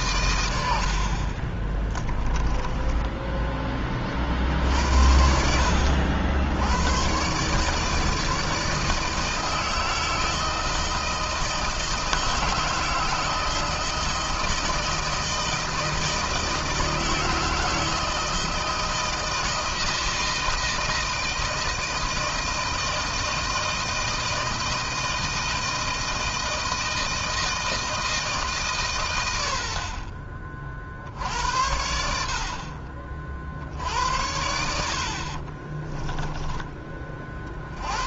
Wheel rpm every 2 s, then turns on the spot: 70, 10, 60, 100, 160, 160, 160, 160, 160, 160, 160, 160, 160, 160, 130, 50, 50, 50, 30.
0-4